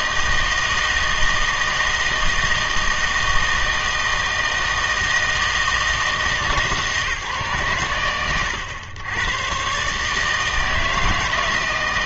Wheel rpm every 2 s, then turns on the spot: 160, 160, 160, 150, 100, 160.
none